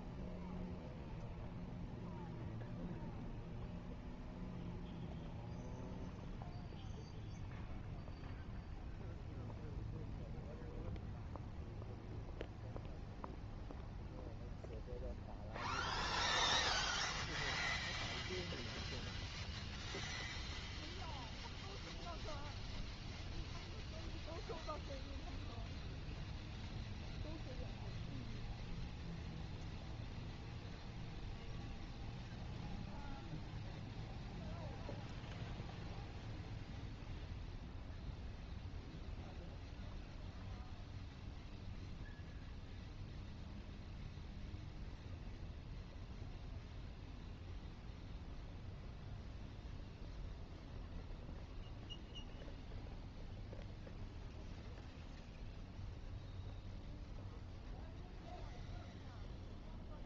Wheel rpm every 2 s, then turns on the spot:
0, 0, 0, 0, 0, 0, 0, 0, 0, 0, 0, 0, 0, 0, 0, 0, 0, 0, 0, 0, 0, 0, 0, 0, 0, 0, 0, 0, 0, 0.
none